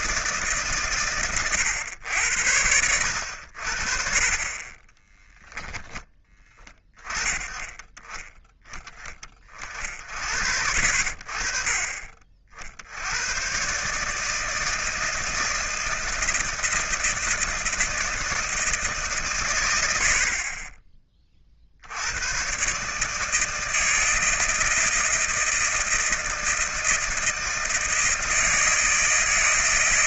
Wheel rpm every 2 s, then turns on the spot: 140, 90, 20, 10, 10, 60, 60, 160, 160, 160, 20, 140, 160, 160, 160.
none